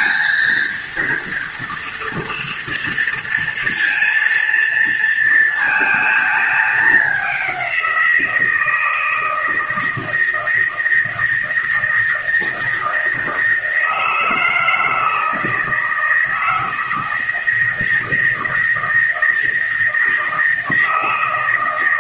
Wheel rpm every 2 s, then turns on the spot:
230, 230, 230, 210, 160, 160, 160, 160, 160, 160, 160.
none